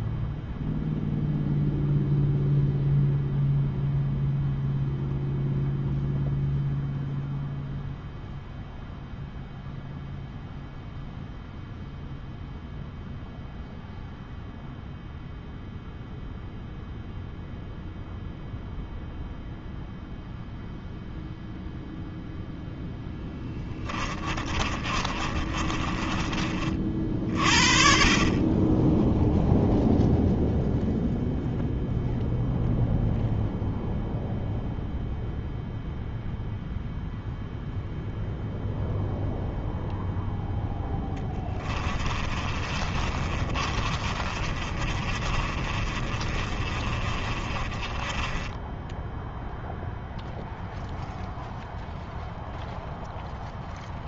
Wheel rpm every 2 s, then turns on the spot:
0, 0, 0, 0, 0, 0, 0, 0, 0, 0, 0, 0, 30, 40, 20, 0, 0, 0, 0, 0, 10, 30, 30, 30, 10, 0, 0.
24-26 42-50